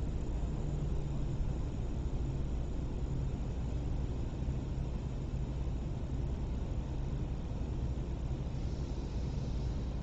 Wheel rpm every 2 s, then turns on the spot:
0, 0, 0, 0, 0.
none